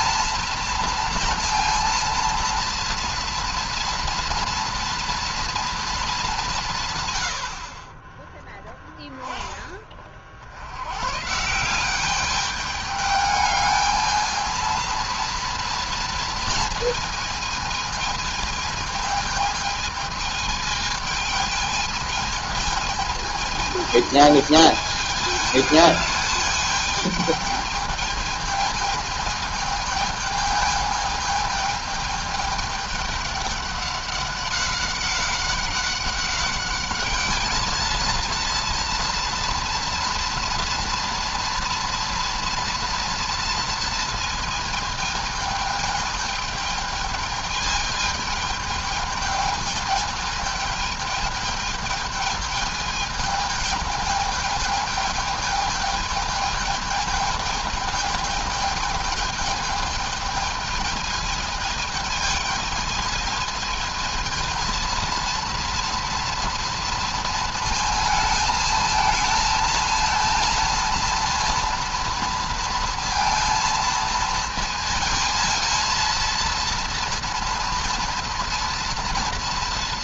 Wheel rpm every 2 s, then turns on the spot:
240, 230, 230, 160, 10, 90, 210, 230, 230, 220, 220, 220, 210, 210, 220, 220, 210, 190, 200, 230, 230, 230, 220, 220, 220, 210, 220, 220, 220, 220, 220, 220, 230, 230, 220, 230, 230, 220, 230, 230.
none